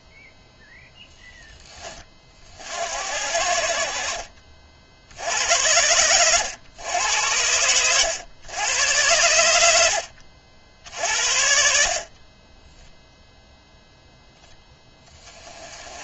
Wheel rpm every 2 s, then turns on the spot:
0, 70, 60, 100, 90, 60, 0, 10.
none